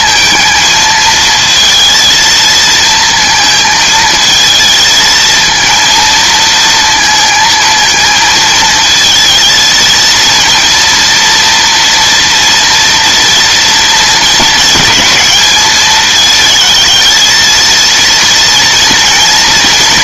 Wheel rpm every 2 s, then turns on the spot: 230, 230, 220, 230, 220, 230, 230, 230, 220, 230.
none